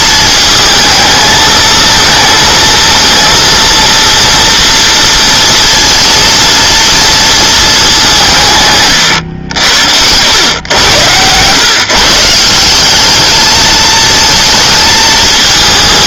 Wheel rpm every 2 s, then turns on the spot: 220, 230, 230, 230, 140, 110, 180, 220.
8-10